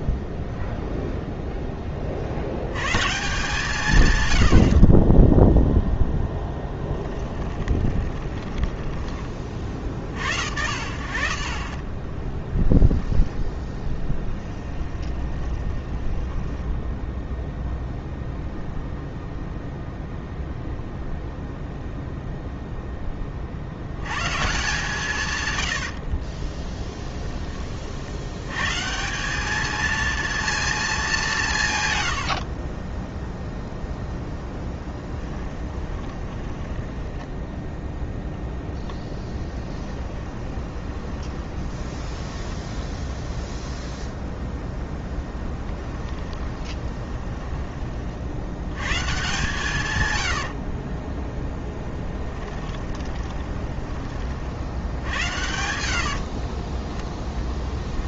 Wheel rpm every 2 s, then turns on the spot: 0, 130, 50, 10, 10, 60, 10, 20, 10, 0, 0, 10, 150, 10, 150, 210, 20, 10, 10, 10, 20, 0, 0, 20, 120, 20, 20, 80, 20.
4-8 12-16 26-28 32-42 46-48 50-56